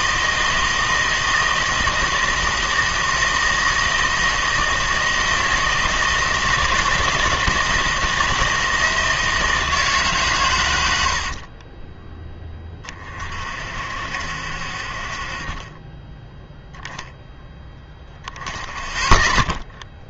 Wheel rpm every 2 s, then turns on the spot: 160, 160, 160, 160, 160, 100, 20, 60, 0, 10.
none